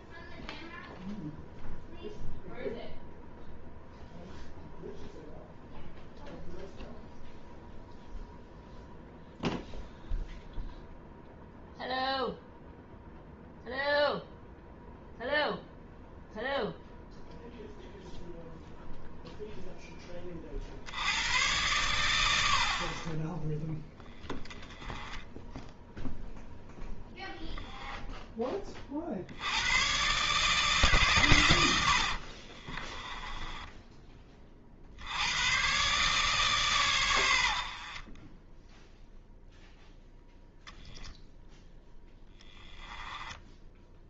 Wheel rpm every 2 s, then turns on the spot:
0, 0, 0, 0, 0, 0, 0, 0, 0, 0, 70, 40, 10, 0, 40, 150, 30, 60, 120, 0, 20, 10.
32-34 42-44